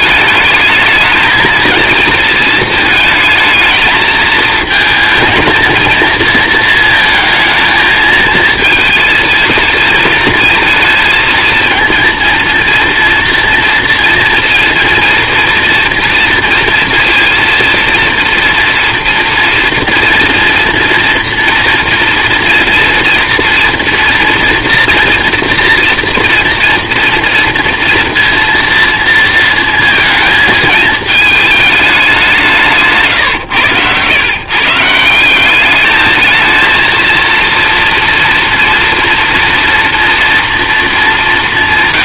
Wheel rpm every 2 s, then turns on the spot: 220, 220, 220, 220, 230, 230, 230, 240, 230, 230, 230, 230, 230, 230, 230, 210, 110, 210, 230, 230, 200.
none